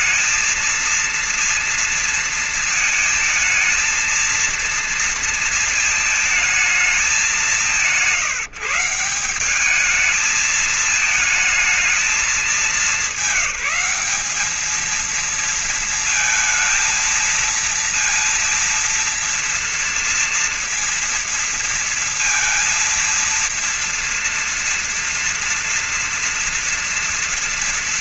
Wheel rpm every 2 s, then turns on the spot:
230, 230, 230, 220, 180, 210, 200, 210, 230, 230, 230, 230, 230, 240.
none